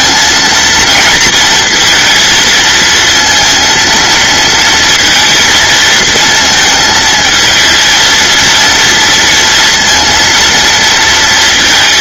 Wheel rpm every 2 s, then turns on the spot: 230, 230, 230, 230, 220, 230.
none